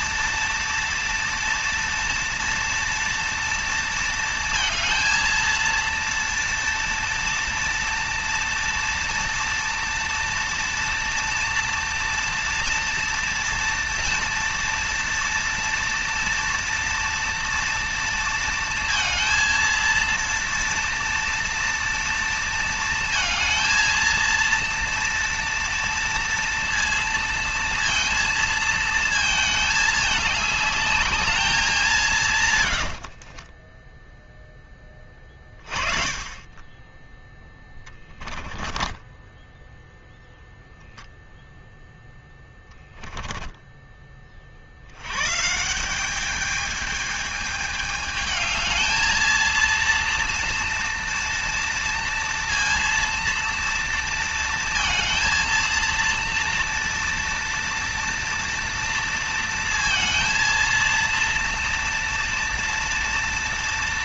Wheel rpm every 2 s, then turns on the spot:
230, 230, 230, 230, 240, 230, 230, 230, 240, 230, 230, 230, 230, 230, 230, 210, 100, 10, 20, 20, 0, 20, 70, 210, 220, 230, 230, 230, 230, 230, 230, 230.
32-34 38-40 42-44